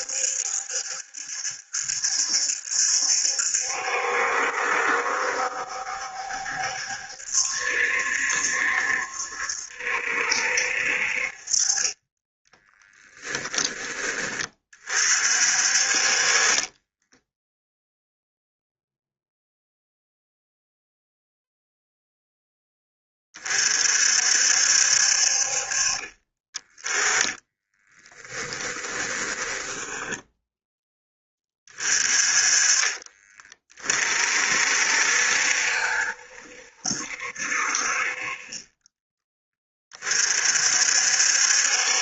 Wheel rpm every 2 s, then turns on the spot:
70, 70, 70, 70, 70, 50, 20, 40, 10, 0, 0, 20, 60, 20, 20, 10, 30, 60, 70, 20, 60.
12-14 16-18 28-30